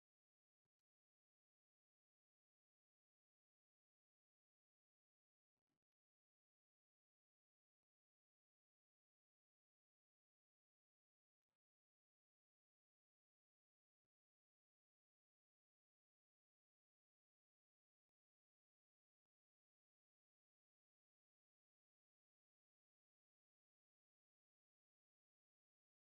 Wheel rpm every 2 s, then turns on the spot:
0, 0, 0, 0, 0, 0, 0, 0, 0, 0, 0, 0, 0.
none